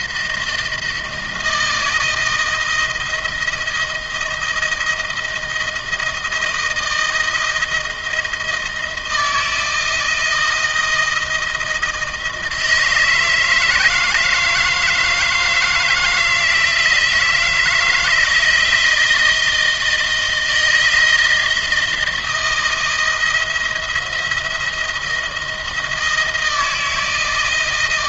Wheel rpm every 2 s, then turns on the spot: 160, 160, 160, 160, 170, 170, 160, 160, 160, 160, 160, 170, 170, 160.
none